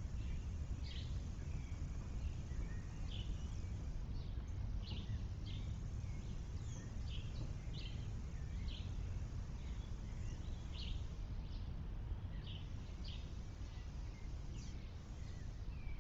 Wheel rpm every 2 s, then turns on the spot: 0, 0, 0, 0, 0, 0, 0, 0.
none